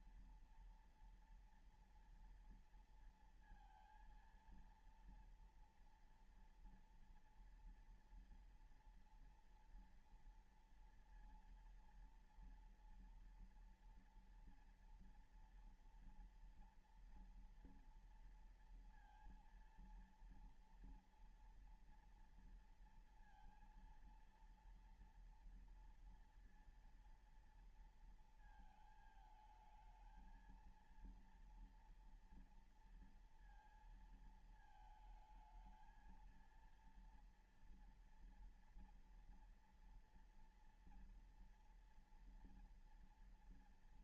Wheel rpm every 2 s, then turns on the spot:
240, 230, 230, 230, 230, 230, 240, 230, 230, 230, 230, 230, 230, 230, 230, 220, 230, 220, 230, 230, 230, 230.
none